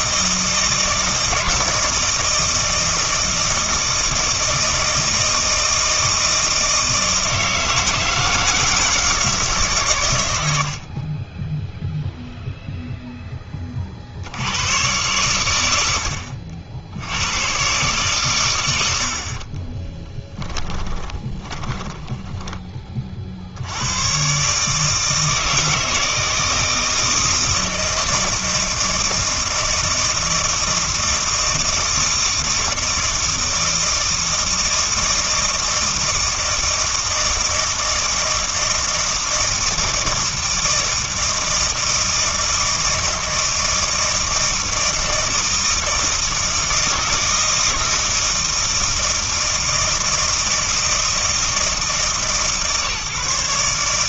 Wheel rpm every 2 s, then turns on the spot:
160, 160, 160, 160, 160, 80, 0, 110, 70, 90, 10, 20, 140, 160, 160, 160, 160, 160, 160, 160, 160, 160, 160, 160, 160, 160, 140.
20-22